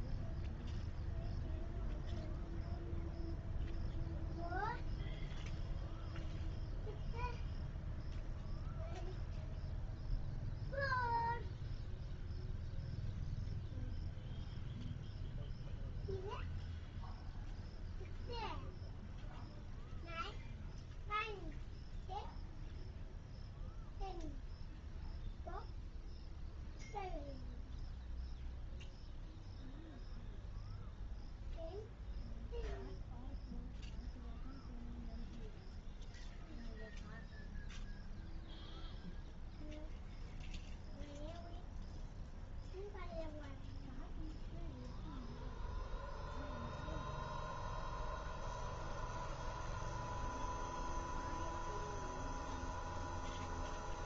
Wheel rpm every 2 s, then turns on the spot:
0, 0, 0, 0, 0, 0, 0, 0, 0, 0, 0, 0, 0, 0, 0, 0, 0, 0, 0, 0, 0, 0, 0, 0, 0, 0, 0.
none